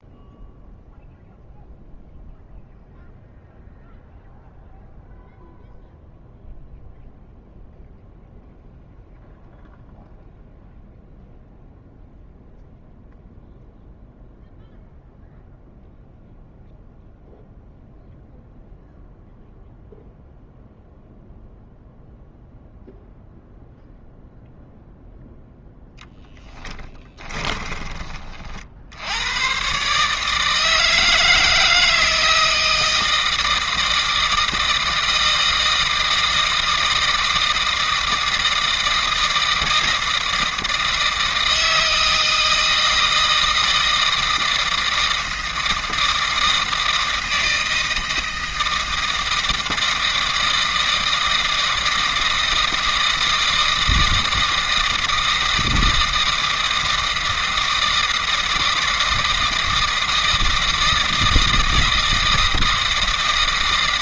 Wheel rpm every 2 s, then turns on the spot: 0, 0, 0, 0, 0, 0, 0, 0, 0, 0, 0, 0, 0, 10, 60, 150, 160, 160, 160, 160, 160, 160, 160, 160, 160, 160, 160, 160, 160, 160, 160, 160.
26-28